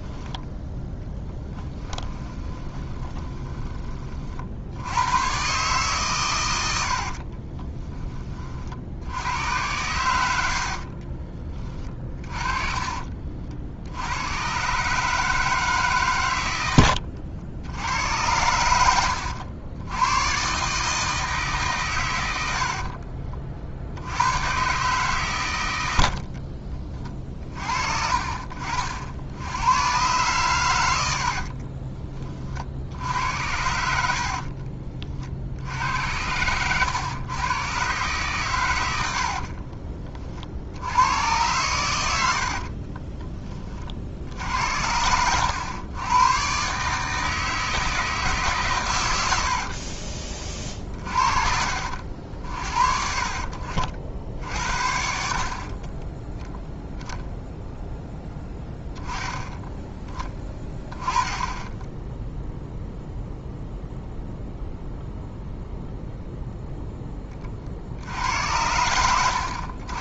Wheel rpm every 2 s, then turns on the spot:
10, 20, 70, 80, 50, 50, 40, 140, 80, 90, 150, 50, 130, 40, 60, 100, 60, 50, 120, 90, 80, 40, 70, 150, 120, 50, 50, 50, 0, 0, 10, 0, 0, 10, 90.
2-4 6-8 10-14 16-18 22-24 34-36 42-44